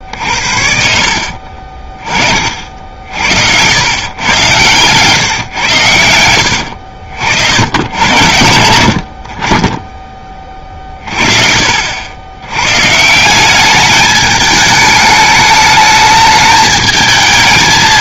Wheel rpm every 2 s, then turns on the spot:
50, 50, 110, 80, 70, 30, 120, 210, 210.
6-8